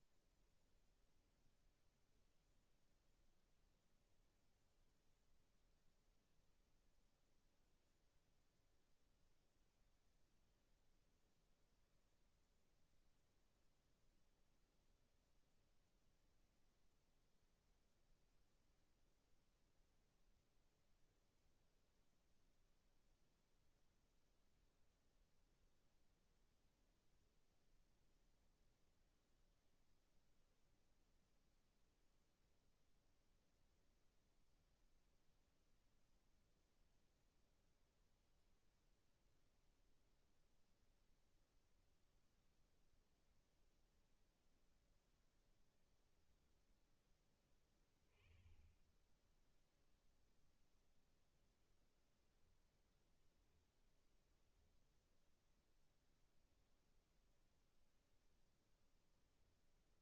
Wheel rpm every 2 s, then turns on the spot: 0, 0, 0, 0, 0, 0, 0, 0, 0, 0, 0, 0, 0, 0, 0, 0, 0, 0, 0, 0, 0, 0, 0, 10, 10, 0, 0, 0, 0, 10.
none